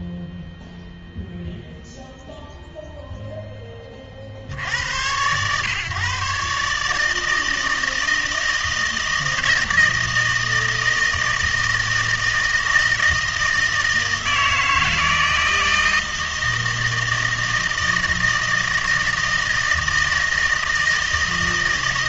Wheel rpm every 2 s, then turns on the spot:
0, 0, 90, 150, 160, 160, 160, 160, 160, 160, 160.
none